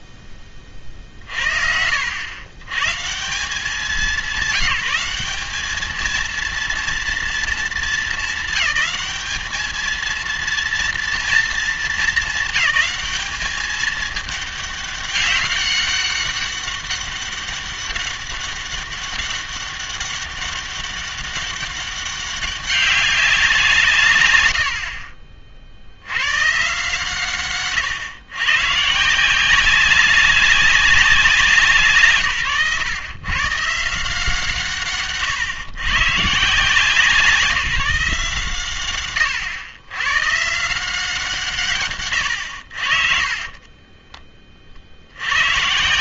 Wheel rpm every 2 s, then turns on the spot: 20, 110, 200, 230, 210, 230, 220, 210, 200, 200, 200, 200, 70, 140, 130, 190, 120, 150, 160, 130, 160, 60, 50.
none